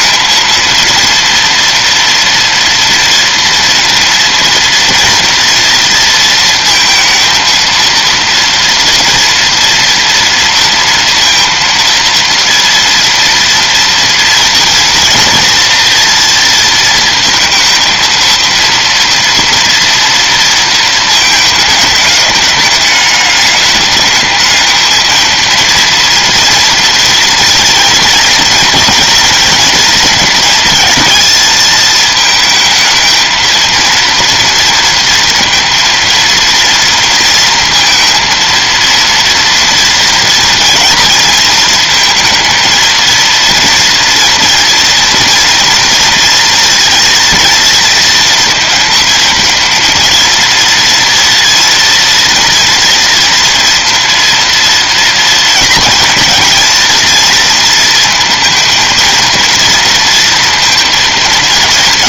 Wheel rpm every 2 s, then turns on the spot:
230, 230, 230, 230, 230, 230, 230, 230, 230, 230, 230, 210, 220, 230, 230, 220, 220, 230, 230, 230, 230, 230, 240, 230, 230, 230, 230, 230, 230, 230, 230.
none